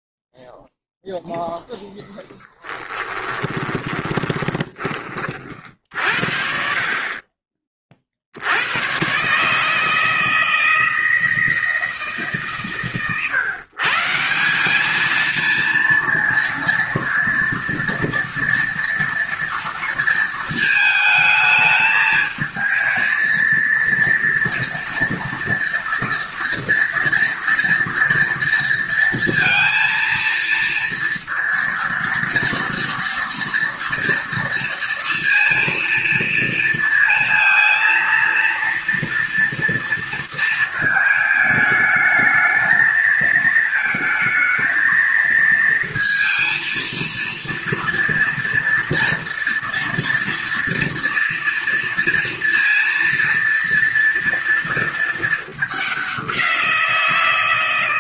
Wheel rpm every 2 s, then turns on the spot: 0, 10, 10, 50, 90, 160, 140, 200, 230, 230, 220, 220, 230, 230, 230, 230, 230, 230, 230, 230, 220, 220, 220, 230, 230, 230, 230, 230, 180.
2-6